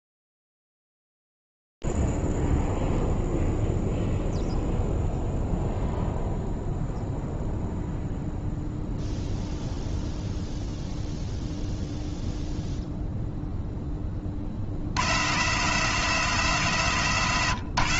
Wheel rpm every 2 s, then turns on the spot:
0, 0, 0, 0, 0, 0, 0, 20, 170.
none